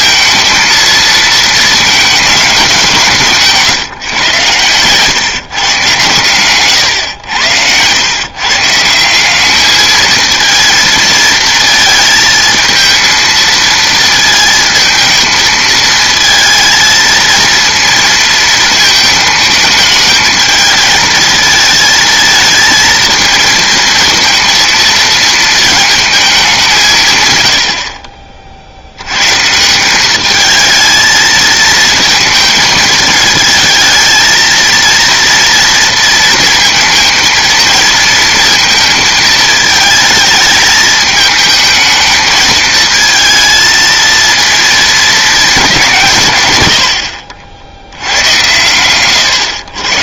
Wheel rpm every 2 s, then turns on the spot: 230, 190, 120, 120, 160, 230, 220, 220, 220, 220, 220, 220, 230, 170, 60, 220, 220, 230, 230, 220, 220, 220, 230, 120, 100.
4-6